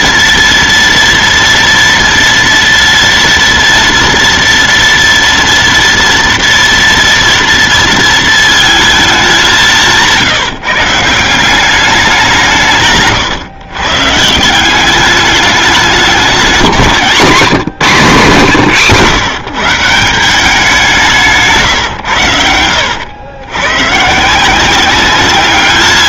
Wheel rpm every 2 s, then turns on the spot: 230, 230, 240, 230, 220, 160, 150, 180, 190, 150, 180, 100, 180.
none